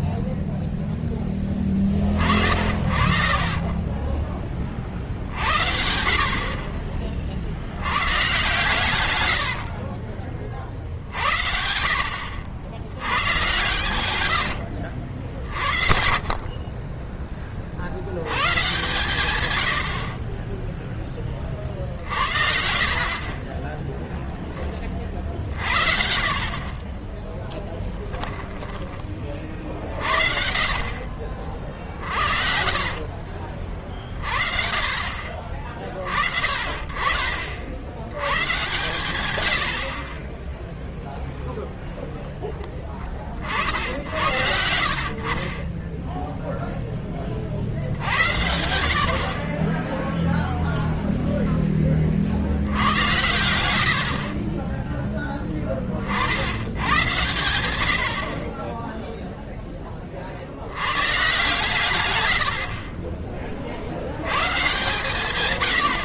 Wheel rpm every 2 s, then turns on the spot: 0, 60, 40, 50, 120, 40, 70, 90, 40, 100, 40, 60, 10, 40, 10, 40, 40, 30, 30, 100, 10, 0, 70, 10, 80, 0, 60, 50, 70, 40, 60, 80, 110.
16-18 28-34 54-56